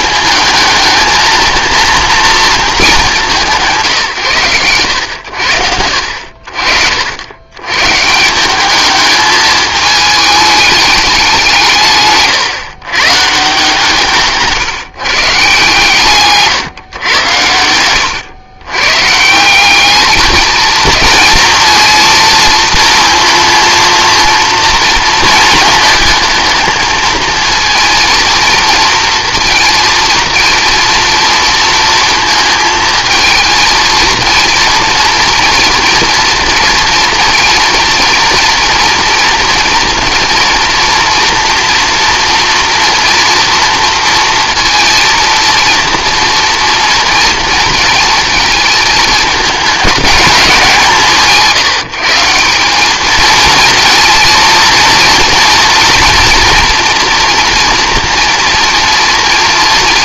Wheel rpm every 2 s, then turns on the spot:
220, 230, 110, 60, 200, 210, 140, 150, 130, 110, 220, 230, 230, 220, 230, 230, 220, 230, 230, 230, 240, 230, 230, 230, 220, 180, 180, 230, 230, 240.
none